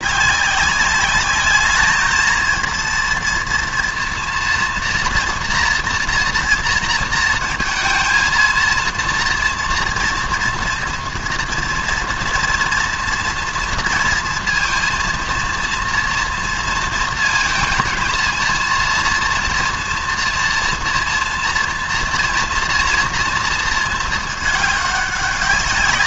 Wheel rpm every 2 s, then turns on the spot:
190, 230, 230, 230, 230, 230, 230, 230, 220, 230, 230, 230, 210.
none